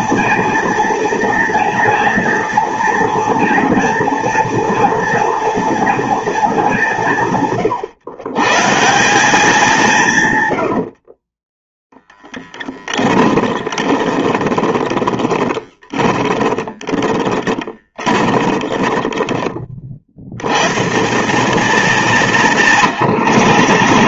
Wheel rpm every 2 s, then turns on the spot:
240, 230, 240, 170, 180, 50, 20, 30, 20, 20, 170, 130.
10-20 22-24